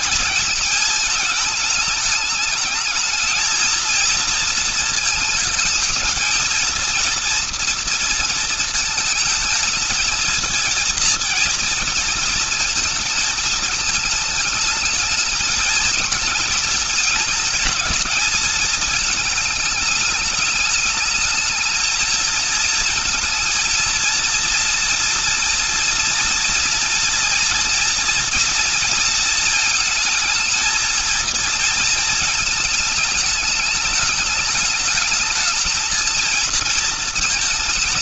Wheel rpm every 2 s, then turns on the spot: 220, 220, 230, 230, 220, 230, 220, 210, 220, 220, 210, 220, 230, 230, 230, 220, 220, 210, 230.
none